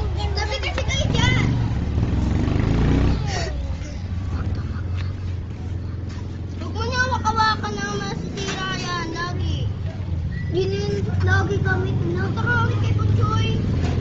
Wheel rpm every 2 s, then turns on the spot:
0, 0, 0, 0, 0, 0, 0.
none